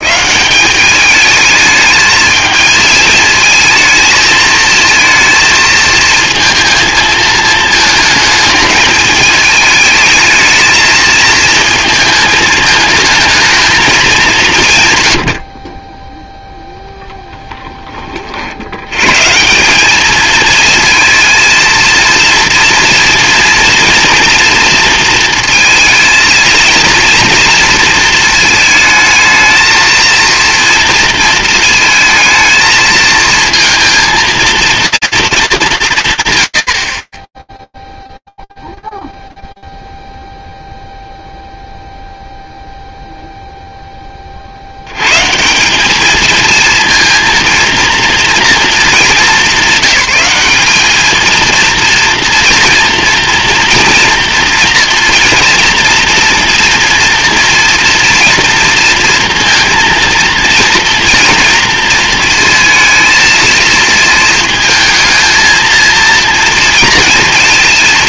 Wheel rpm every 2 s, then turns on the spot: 210, 220, 220, 230, 220, 220, 220, 140, 0, 70, 220, 230, 240, 230, 220, 230, 230, 230, 70, 0, 0, 0, 90, 230, 210, 210, 230, 230, 230, 230, 230, 230, 220, 230.
none